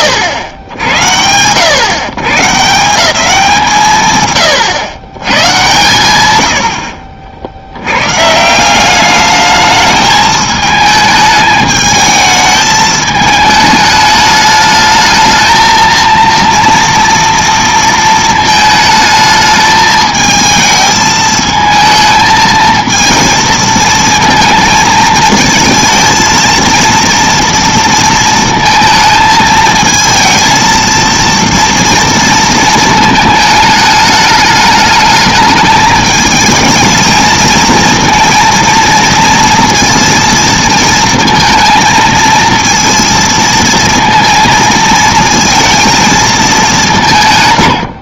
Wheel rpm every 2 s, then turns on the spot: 130, 120, 110, 140, 220, 220, 210, 230, 220, 220, 220, 230, 230, 230, 220, 230, 210, 220, 230, 230, 220, 230, 220, 70.
46-48